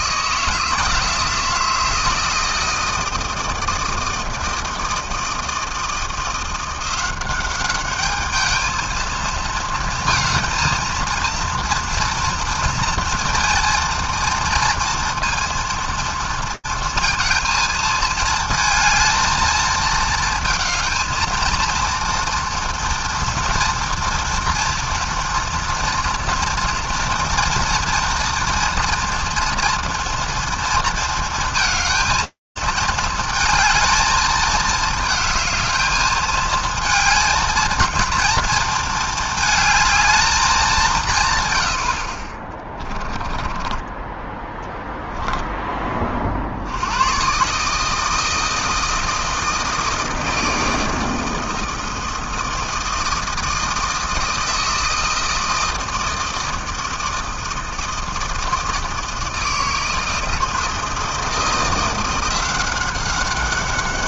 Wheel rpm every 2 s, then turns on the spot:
160, 160, 160, 170, 220, 220, 230, 230, 230, 220, 220, 230, 230, 230, 230, 230, 230, 220, 220, 230, 200, 20, 10, 50, 160, 160, 160, 160, 160, 160, 160, 180.
42-44